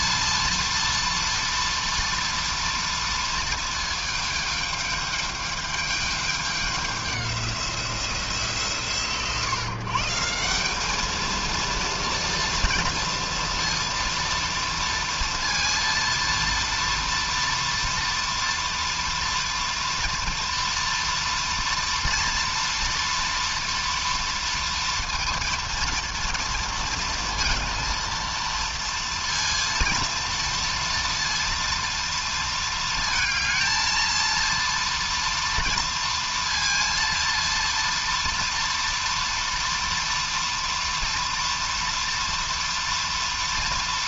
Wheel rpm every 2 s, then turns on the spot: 230, 230, 220, 210, 160, 180, 230, 230, 230, 230, 230, 230, 230, 230, 230, 230, 230, 230, 230, 230, 230, 230.
none